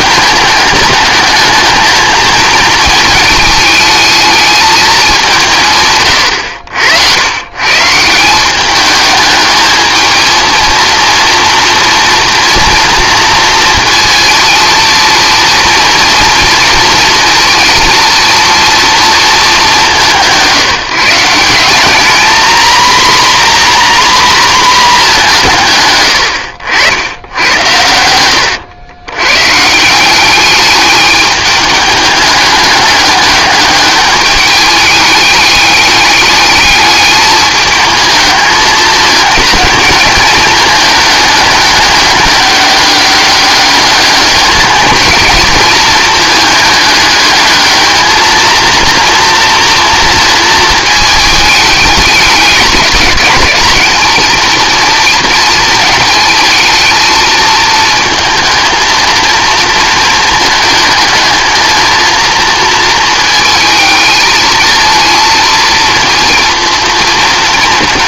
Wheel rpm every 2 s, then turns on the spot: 210, 220, 220, 100, 210, 230, 230, 230, 220, 230, 180, 250, 220, 80, 100, 210, 200, 200, 210, 210, 220, 200, 220, 210, 230, 220, 210, 230, 220, 230, 220, 230, 220, 230.
none